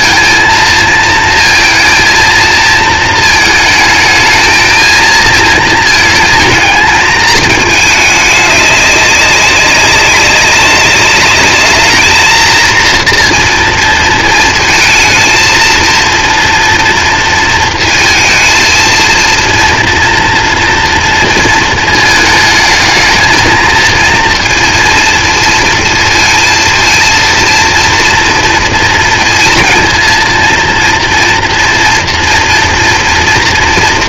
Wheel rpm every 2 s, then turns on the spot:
230, 230, 220, 220, 200, 200, 230, 220, 230, 230, 230, 220, 230, 230, 230, 230, 230.
none